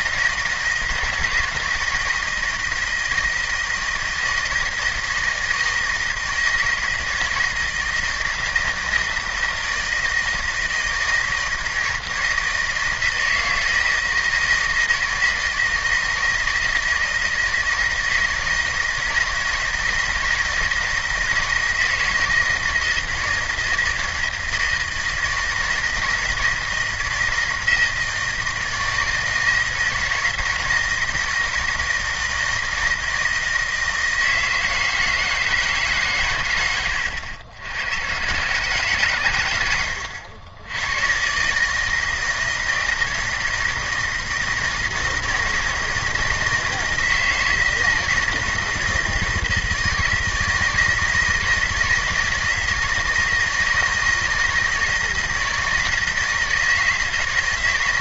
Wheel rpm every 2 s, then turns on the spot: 160, 160, 160, 160, 160, 160, 160, 160, 160, 160, 160, 160, 160, 160, 160, 170, 160, 160, 100, 140, 100, 160, 160, 160, 160, 160, 160, 160, 160.
none